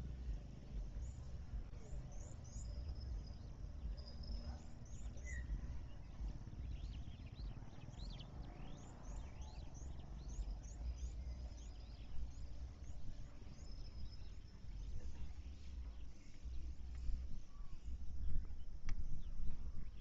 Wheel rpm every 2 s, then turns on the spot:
0, 0, 0, 0, 0, 0, 0, 0, 0, 0.
none